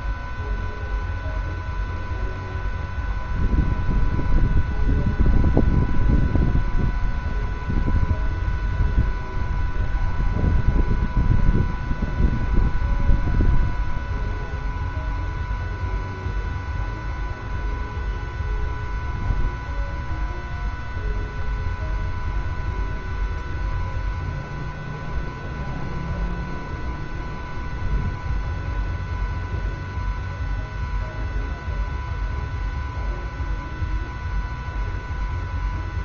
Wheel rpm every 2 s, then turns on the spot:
0, 0, 0, 0, 0, 0, 0, 0, 0, 0, 0, 0, 0, 0, 0, 0, 0, 0.
none